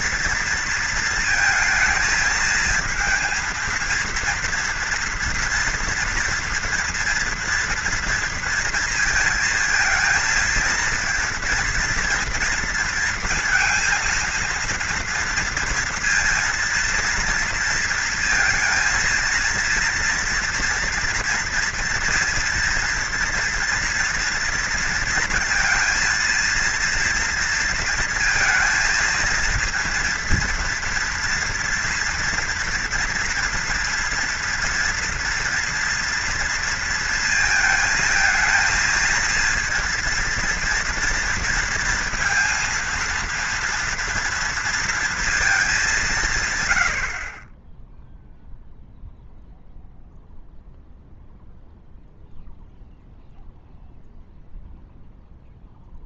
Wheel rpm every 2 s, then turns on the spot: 230, 220, 230, 230, 230, 230, 230, 230, 230, 230, 230, 240, 230, 230, 220, 230, 230, 230, 230, 220, 230, 230, 230, 130, 0, 0, 0, 0.
none